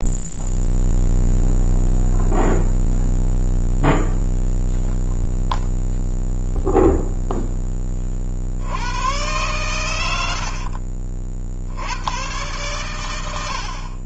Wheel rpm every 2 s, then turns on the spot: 0, 0, 0, 0, 100, 60, 120.
none